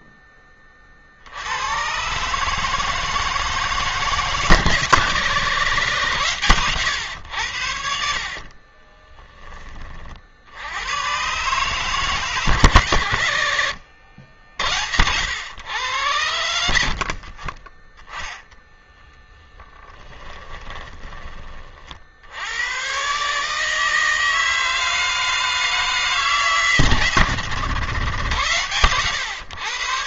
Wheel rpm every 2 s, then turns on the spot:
10, 150, 150, 120, 40, 70, 130, 80, 90, 10, 20, 90, 160, 150, 120.
8-10 20-22